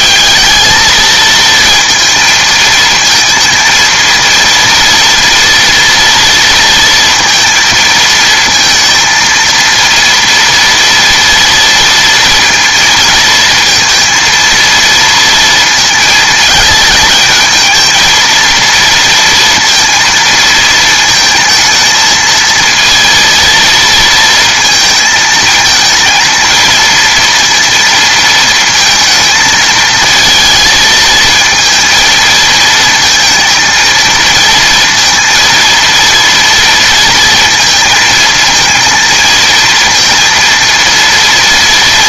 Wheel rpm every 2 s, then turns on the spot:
220, 220, 230, 230, 230, 230, 230, 230, 220, 230, 230, 230, 230, 230, 230, 220, 220, 230, 230, 230, 230.
none